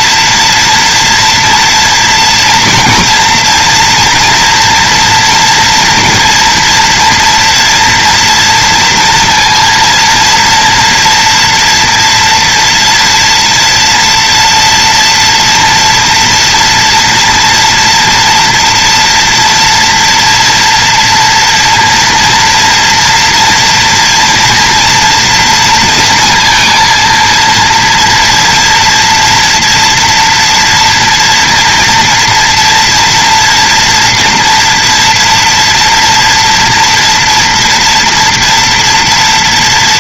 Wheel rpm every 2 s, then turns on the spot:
230, 230, 230, 230, 240, 230, 240, 230, 230, 230, 230, 230, 230, 230, 230, 230, 230, 240, 230, 230.
none